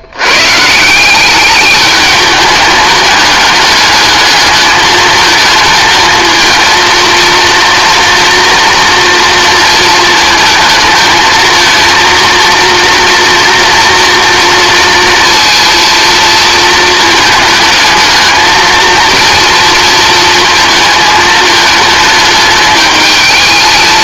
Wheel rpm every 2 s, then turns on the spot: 170, 210, 220, 230, 230, 220, 230, 230, 220, 230, 220, 220.
none